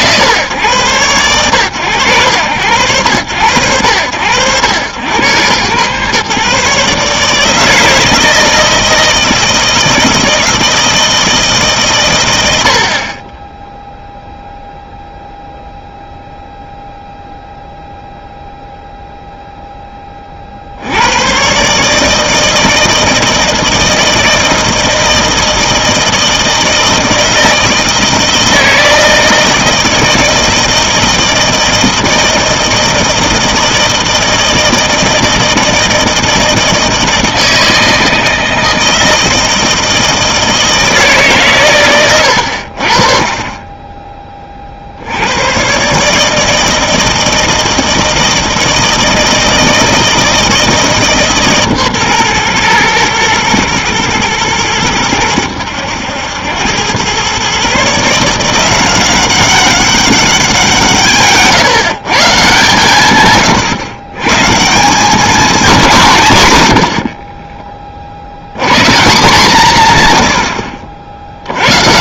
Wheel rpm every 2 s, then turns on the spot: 130, 100, 100, 140, 160, 160, 80, 0, 0, 0, 60, 160, 160, 160, 160, 160, 160, 160, 160, 160, 160, 60, 40, 160, 160, 160, 120, 110, 100, 180, 170, 130, 160, 80, 130, 70.
none